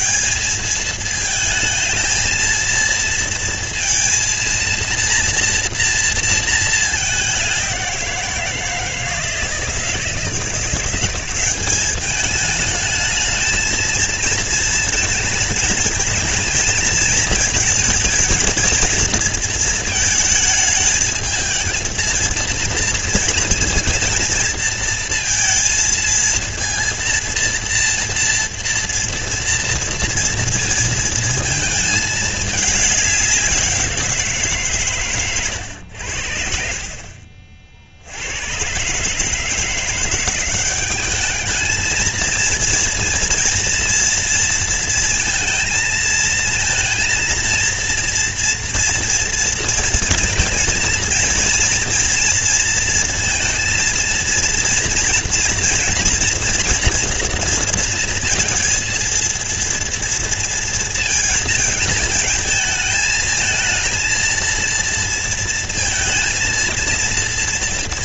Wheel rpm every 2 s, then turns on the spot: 190, 230, 230, 230, 180, 160, 200, 230, 220, 220, 220, 230, 230, 230, 230, 230, 220, 180, 90, 70, 170, 220, 230, 220, 230, 230, 230, 230, 230, 230, 230, 220, 230, 230.
none